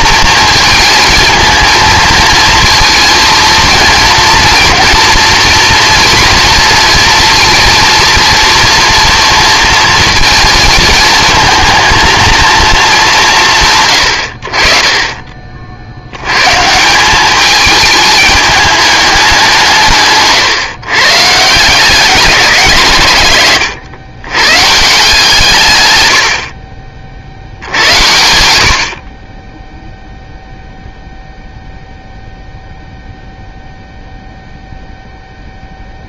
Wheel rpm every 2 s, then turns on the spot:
220, 230, 230, 230, 230, 230, 200, 40, 160, 210, 130, 140, 160, 40, 50, 0, 0, 0.
none